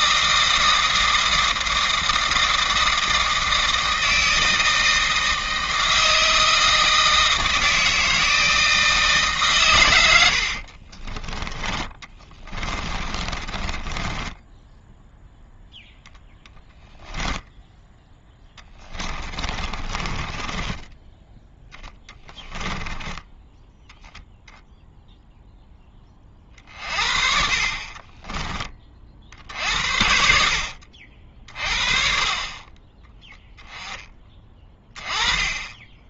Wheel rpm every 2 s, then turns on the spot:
160, 160, 160, 160, 160, 40, 20, 10, 10, 20, 10, 20, 0, 40, 30, 60, 20, 20.
10-16 18-24